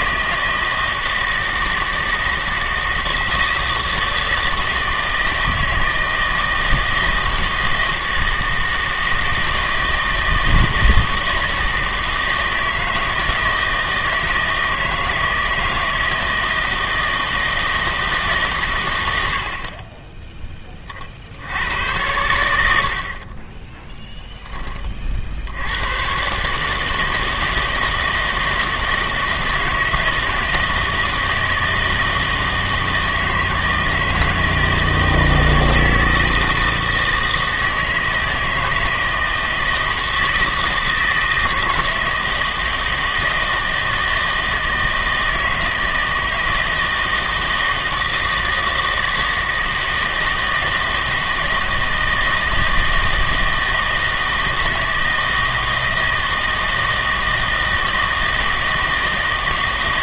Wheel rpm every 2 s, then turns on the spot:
160, 160, 160, 160, 160, 160, 160, 160, 160, 140, 20, 80, 20, 150, 160, 160, 160, 160, 160, 160, 160, 160, 160, 160, 160, 160, 160, 160, 160, 160.
none